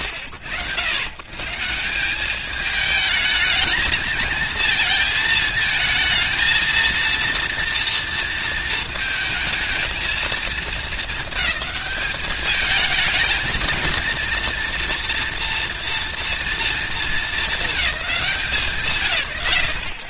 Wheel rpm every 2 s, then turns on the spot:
80, 200, 220, 230, 220, 220, 210, 230, 230, 190.
none